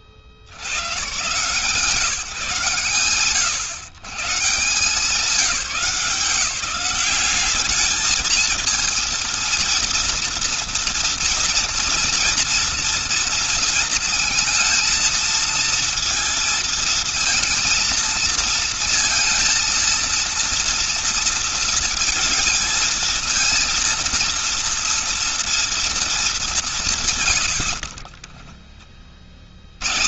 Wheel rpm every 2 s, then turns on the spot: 70, 120, 150, 180, 230, 230, 230, 230, 230, 230, 230, 220, 230, 190, 0.
none